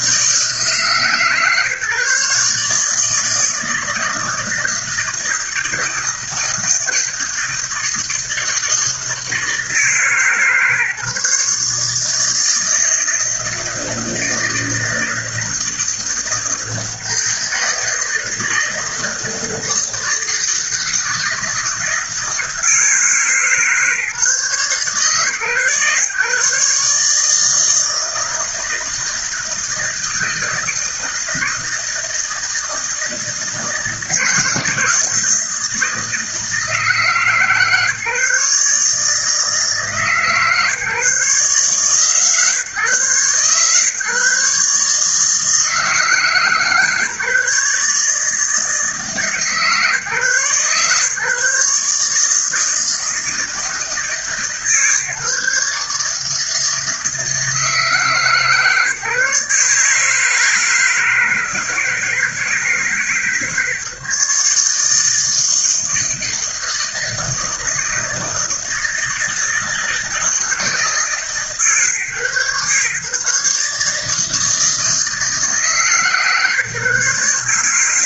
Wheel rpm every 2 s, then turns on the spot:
150, 150, 160, 160, 160, 150, 160, 160, 160, 160, 160, 160, 130, 140, 160, 160, 160, 160, 150, 150, 150, 140, 150, 150, 160, 140, 160, 150, 160, 150, 160, 150, 160, 160, 160, 150, 140, 160, 140.
none